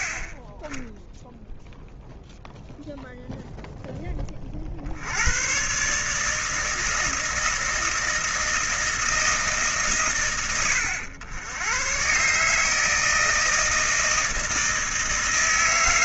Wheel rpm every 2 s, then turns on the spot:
10, 0, 50, 160, 160, 90, 160, 160.
none